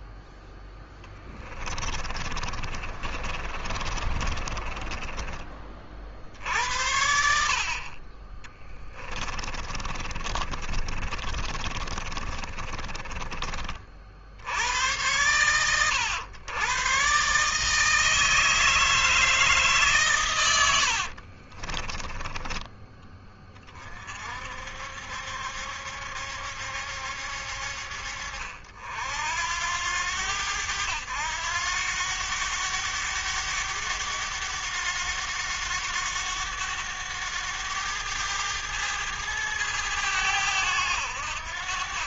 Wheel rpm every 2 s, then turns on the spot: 0, 30, 30, 60, 30, 30, 30, 80, 100, 160, 110, 20, 60, 70, 60, 100, 100, 100, 100, 100, 90.
2-6 8-14 22-24